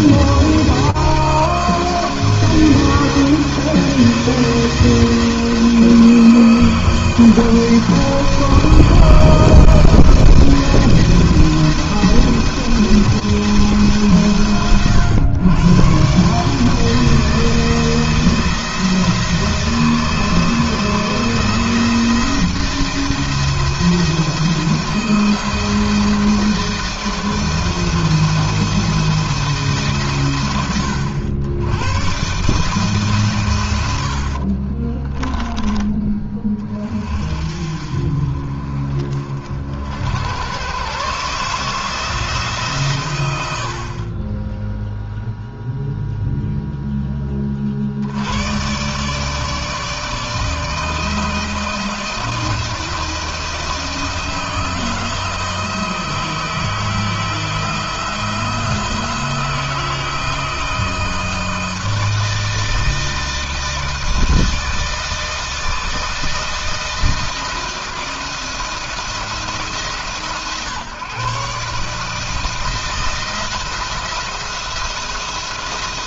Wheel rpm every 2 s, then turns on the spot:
170, 160, 160, 160, 160, 160, 170, 120, 160, 160, 160, 160, 170, 160, 170, 100, 150, 30, 40, 40, 130, 130, 0, 10, 130, 160, 160, 160, 160, 160, 160, 160, 160, 160, 170, 140, 160, 160.
34-36